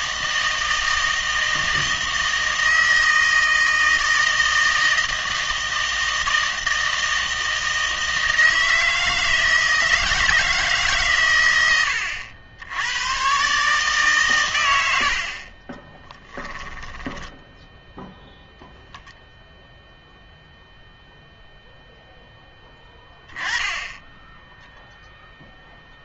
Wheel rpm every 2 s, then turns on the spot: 160, 160, 160, 160, 160, 150, 80, 90, 20, 0, 0, 10, 0.
16-18